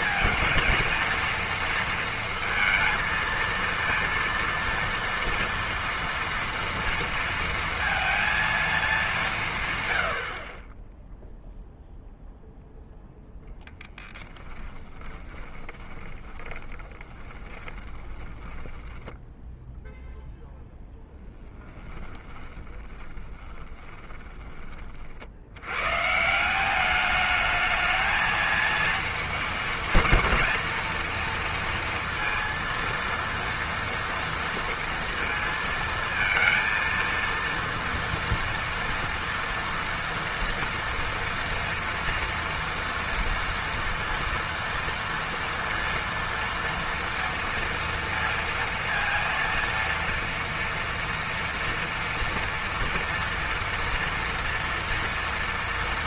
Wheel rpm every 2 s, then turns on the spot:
230, 230, 230, 230, 220, 10, 0, 10, 10, 10, 0, 20, 40, 200, 230, 230, 230, 230, 230, 240, 230, 230, 230, 230, 230, 230, 230, 230.
14-20 22-24